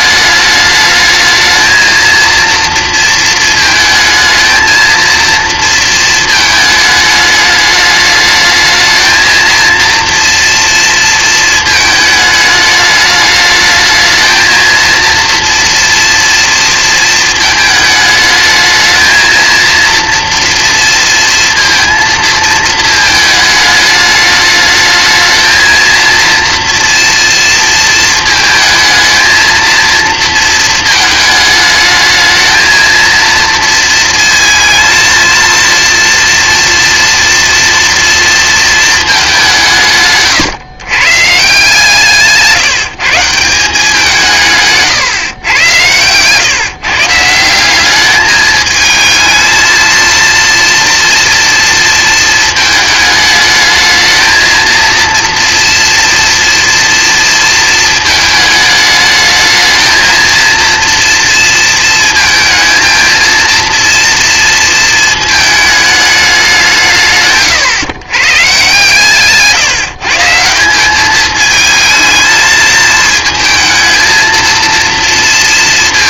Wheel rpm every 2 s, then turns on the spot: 210, 230, 220, 220, 220, 230, 210, 230, 230, 220, 230, 220, 220, 240, 230, 220, 220, 230, 230, 220, 130, 170, 140, 140, 210, 230, 220, 230, 230, 210, 230, 230, 230, 160, 140, 200, 220, 230.
none